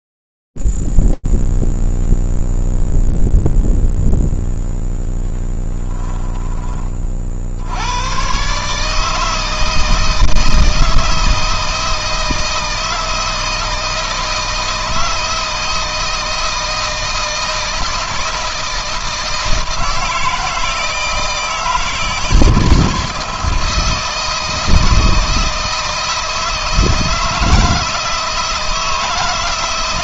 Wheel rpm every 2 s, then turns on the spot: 0, 0, 0, 10, 120, 160, 160, 160, 160, 160, 160, 160, 160, 160, 160.
none